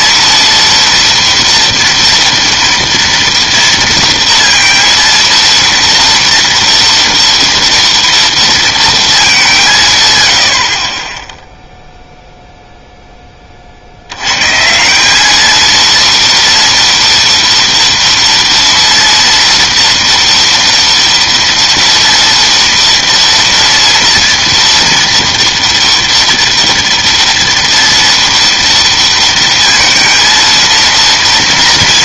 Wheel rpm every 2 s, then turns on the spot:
230, 230, 230, 230, 230, 60, 0, 150, 230, 230, 230, 230, 230, 230, 230, 230.
none